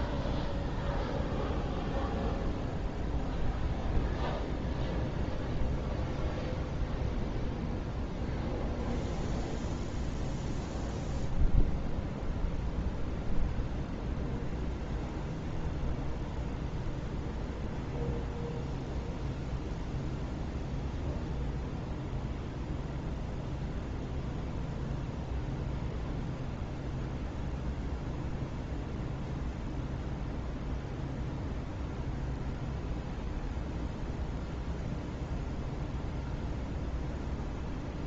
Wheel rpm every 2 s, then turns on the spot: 0, 0, 0, 0, 0, 0, 0, 0, 0, 0, 0, 0, 0, 0, 0, 0, 0, 0, 0.
none